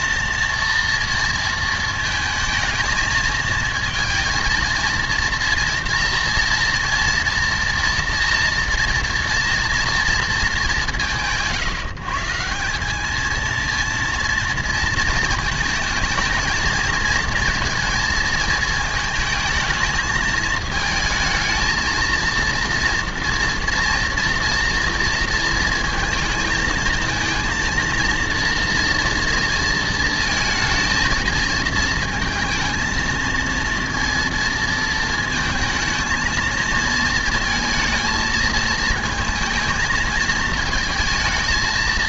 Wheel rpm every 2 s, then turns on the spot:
230, 230, 230, 230, 230, 220, 170, 230, 220, 220, 220, 230, 230, 220, 230, 220, 230, 230, 230, 220, 220.
none